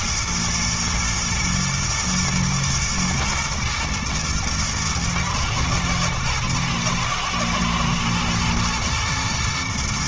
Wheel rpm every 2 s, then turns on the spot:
110, 110, 110, 110, 120.
none